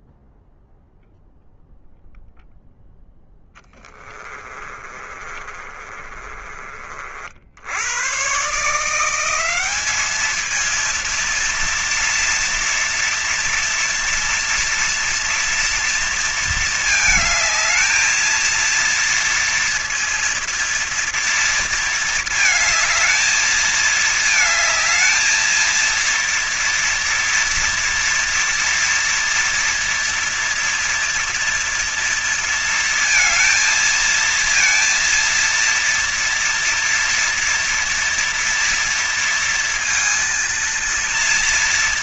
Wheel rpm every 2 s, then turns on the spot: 0, 0, 20, 40, 150, 220, 230, 240, 230, 230, 230, 220, 220, 230, 230, 230, 230, 230, 230, 230, 230.
4-6